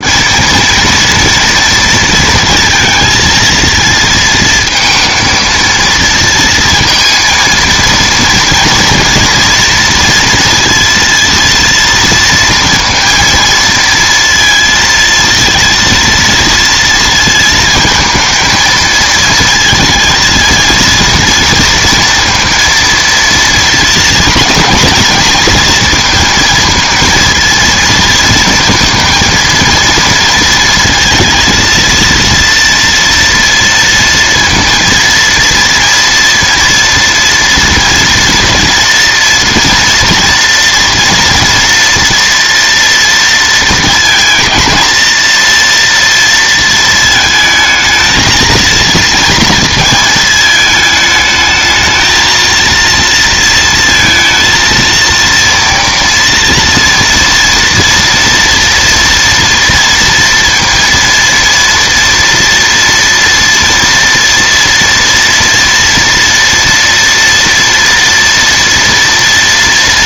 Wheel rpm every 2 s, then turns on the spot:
230, 230, 230, 230, 230, 230, 230, 230, 230, 220, 230, 230, 230, 230, 230, 230, 230, 230, 230, 230, 230, 230, 230, 220, 230, 220, 230, 230, 230, 240, 230, 230, 230, 230, 230.
none